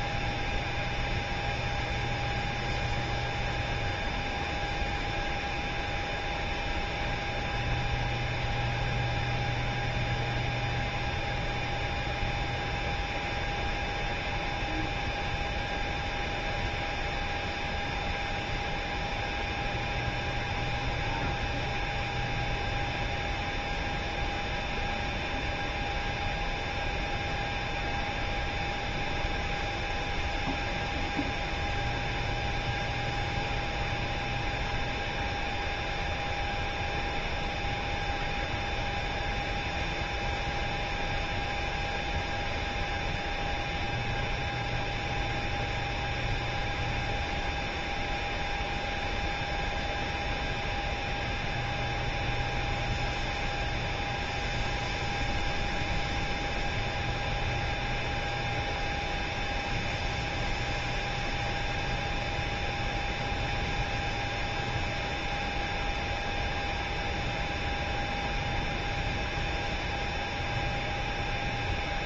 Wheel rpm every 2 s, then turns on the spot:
0, 0, 0, 0, 0, 0, 0, 0, 0, 0, 0, 0, 0, 0, 0, 0, 0, 0, 0, 0, 0, 0, 0, 0, 0, 0, 0, 0, 0, 0, 0, 0, 0, 0, 0, 0.
none